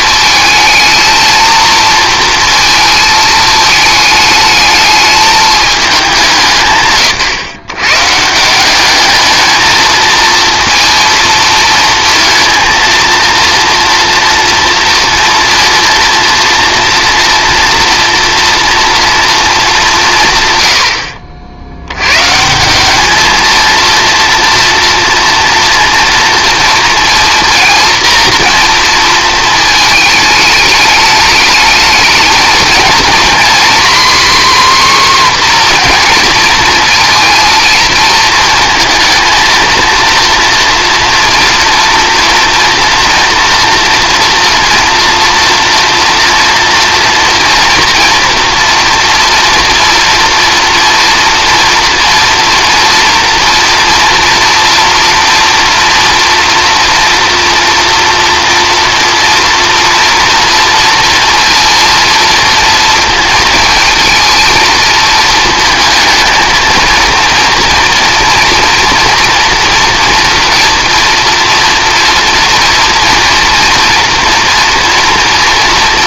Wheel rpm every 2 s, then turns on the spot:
220, 230, 210, 160, 200, 230, 230, 230, 230, 230, 90, 180, 230, 230, 230, 210, 220, 260, 230, 230, 230, 230, 230, 230, 230, 230, 240, 230, 230, 230, 230, 230, 220, 230, 230, 240, 230, 230.
none